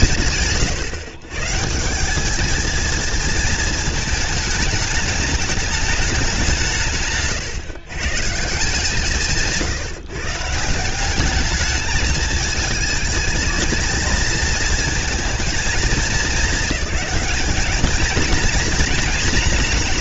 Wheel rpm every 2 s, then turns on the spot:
130, 230, 210, 130, 150, 210, 220, 220, 210, 230.
8-10